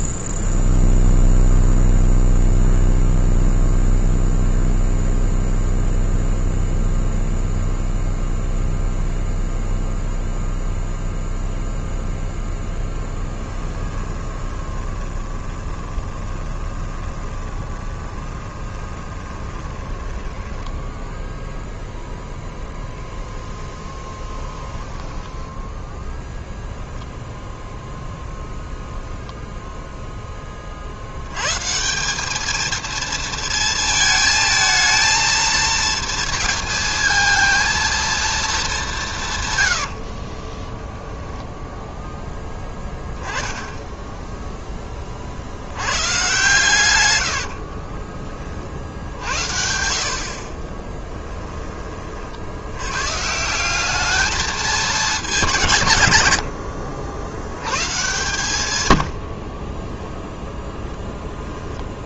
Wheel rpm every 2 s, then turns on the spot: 0, 0, 0, 0, 0, 0, 10, 20, 20, 20, 0, 0, 10, 10, 0, 50, 220, 220, 230, 200, 10, 10, 20, 110, 60, 20, 110, 220, 80, 110, 10.
12-20 24-26 40-42 46-48 50-52 56-60